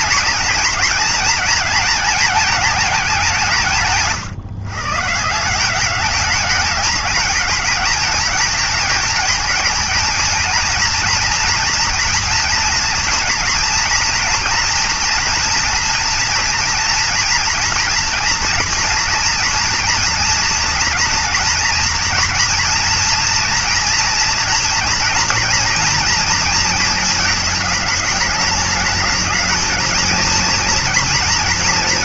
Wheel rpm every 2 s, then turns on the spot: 230, 200, 150, 220, 220, 240, 230, 240, 230, 230, 230, 230, 240, 220, 220, 240.
none